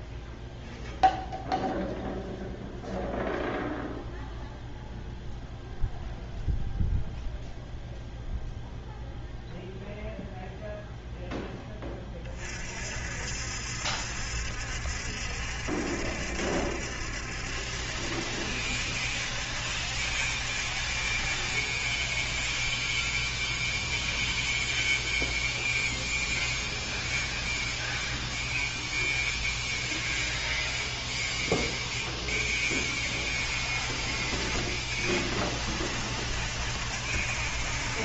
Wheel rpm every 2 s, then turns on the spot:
0, 0, 0, 0, 0, 0, 50, 70, 70, 70, 50, 10, 0, 0, 0, 0, 20, 50, 70.
none